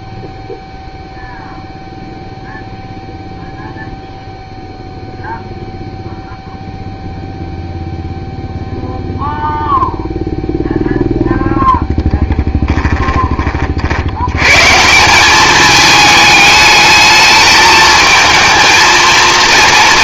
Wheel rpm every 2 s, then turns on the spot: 0, 0, 0, 0, 0, 0, 10, 160, 220, 230.
12-14